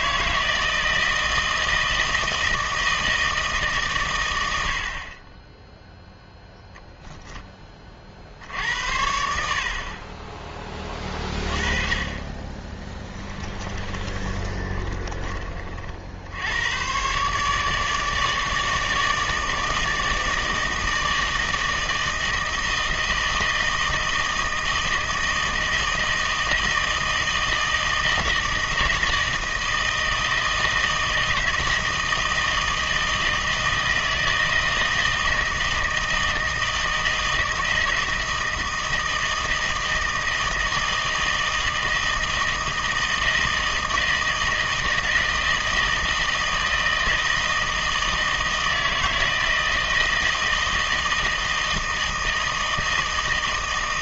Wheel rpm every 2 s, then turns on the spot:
160, 160, 60, 0, 80, 20, 20, 30, 120, 160, 160, 160, 160, 160, 160, 160, 160, 160, 160, 160, 160, 160, 160, 160, 160, 160, 160.
12-16